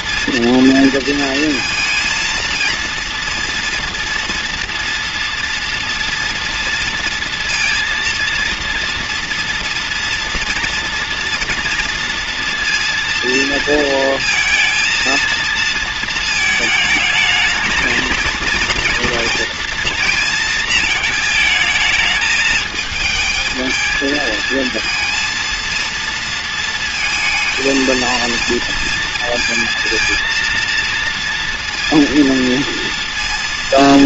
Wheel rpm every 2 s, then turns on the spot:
230, 230, 240, 230, 230, 230, 230, 230, 220, 230, 220, 220, 230, 230, 230, 230, 230.
none